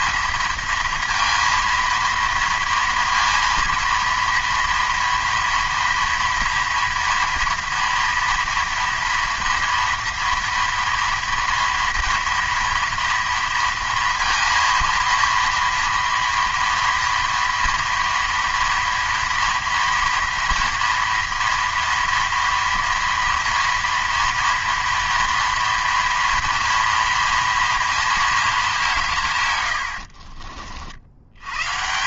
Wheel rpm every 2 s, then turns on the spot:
230, 230, 230, 230, 230, 230, 240, 230, 230, 230, 240, 230, 230, 230, 200, 60.
none